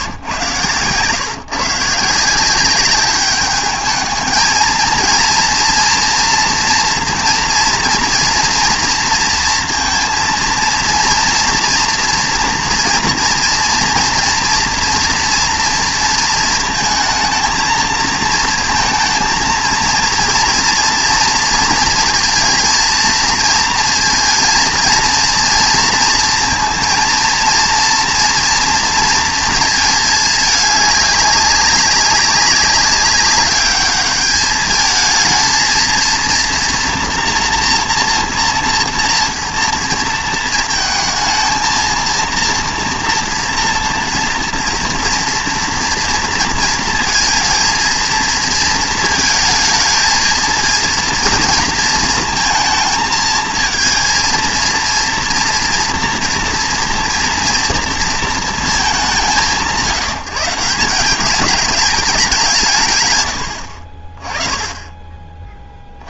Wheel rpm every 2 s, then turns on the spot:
120, 190, 230, 230, 230, 230, 230, 230, 220, 230, 230, 230, 230, 230, 230, 200, 200, 220, 230, 230, 230, 230, 230, 230, 230, 220, 220, 230, 230, 210, 170, 160, 20.
none